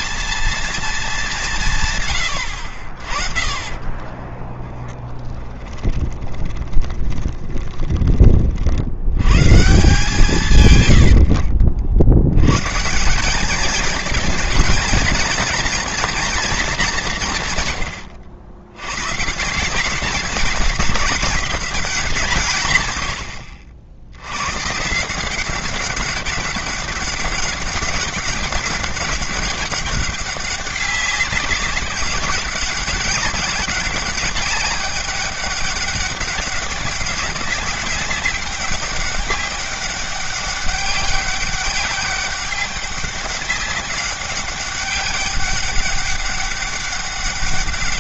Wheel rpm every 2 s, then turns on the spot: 210, 50, 20, 20, 80, 80, 170, 230, 200, 120, 210, 110, 150, 200, 200, 190, 190, 200, 200, 200, 200, 200, 190, 200.
2-8 10-12